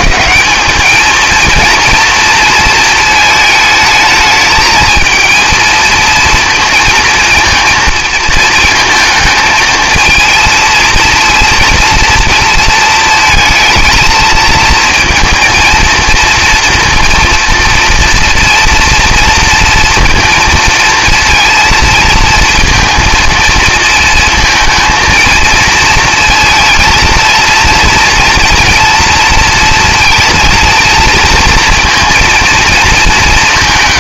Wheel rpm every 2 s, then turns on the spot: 200, 220, 220, 230, 220, 230, 230, 230, 230, 240, 230, 230, 230, 230, 230, 230, 220.
none